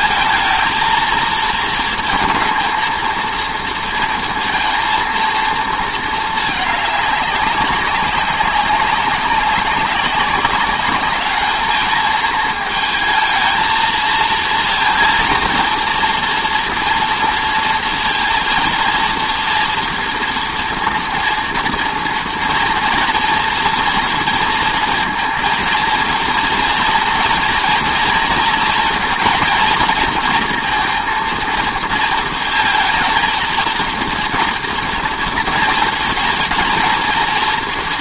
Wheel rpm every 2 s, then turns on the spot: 230, 230, 230, 210, 190, 190, 220, 230, 230, 230, 230, 230, 230, 230, 230, 230, 220, 230, 230.
none